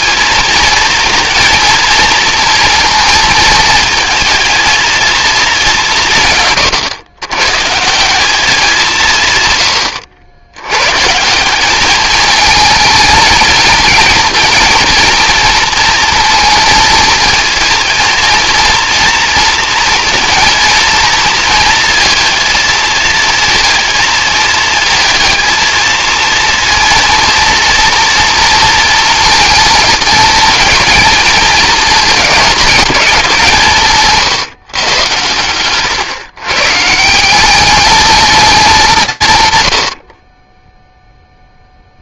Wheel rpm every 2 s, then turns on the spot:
220, 230, 230, 130, 190, 110, 220, 230, 230, 230, 230, 220, 220, 230, 230, 230, 210, 130, 140, 190, 0.
none